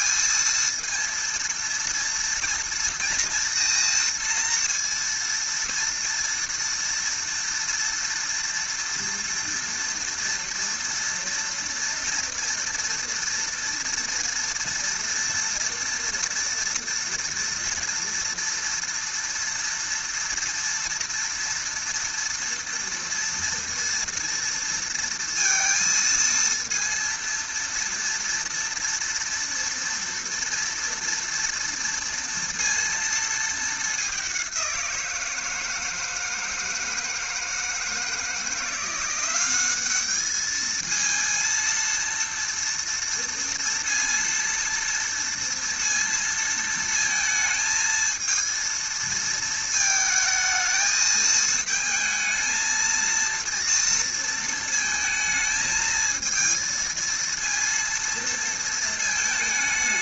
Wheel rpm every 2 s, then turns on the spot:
230, 230, 230, 230, 230, 230, 230, 230, 230, 230, 230, 230, 230, 230, 230, 230, 230, 190, 160, 170, 220, 230, 230, 230, 230, 220, 230, 230, 230, 230.
none